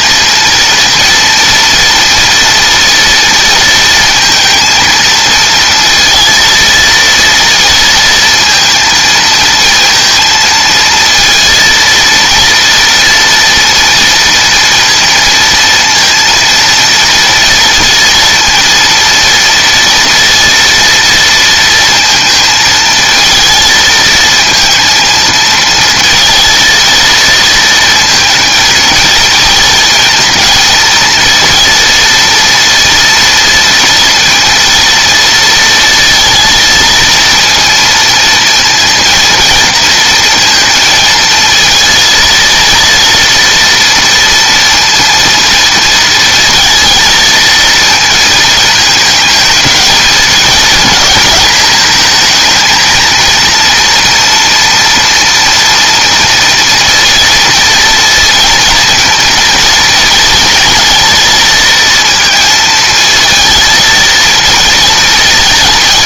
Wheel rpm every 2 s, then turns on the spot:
230, 230, 230, 230, 230, 230, 230, 230, 230, 230, 230, 230, 230, 230, 230, 220, 230, 230, 230, 230, 230, 230, 230, 230, 220, 220, 220, 230, 230, 230, 230, 230, 230.
none